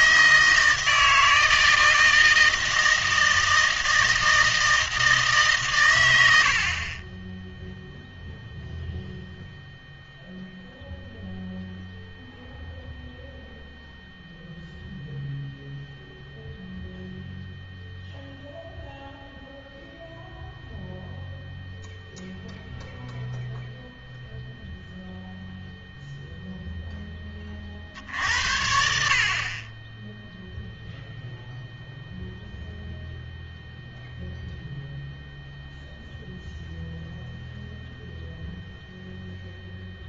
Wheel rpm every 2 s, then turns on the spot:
160, 160, 160, 80, 0, 0, 0, 0, 0, 0, 0, 0, 0, 0, 70, 0, 0, 0, 0, 0.
none